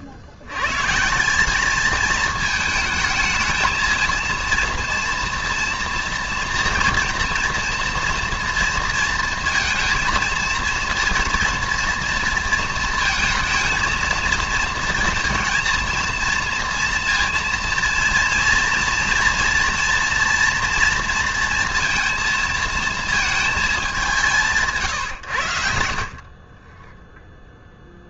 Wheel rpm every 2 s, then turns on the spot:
90, 220, 230, 230, 230, 230, 230, 230, 230, 230, 230, 220, 160, 30.
none